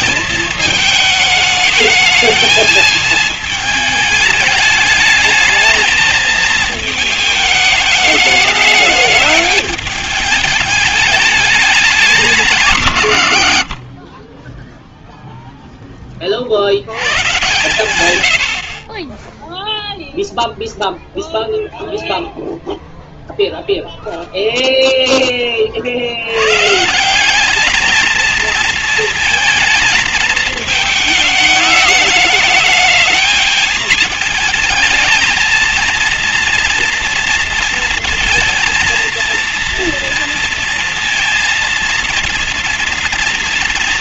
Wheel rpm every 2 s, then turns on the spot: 220, 220, 210, 220, 210, 210, 140, 0, 90, 30, 0, 0, 0, 160, 230, 220, 220, 220, 230, 230, 230, 240.
none